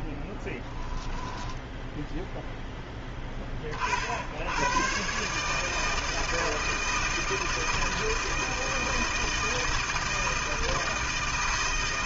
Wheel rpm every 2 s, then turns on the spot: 10, 10, 80, 160, 160, 160.
2-4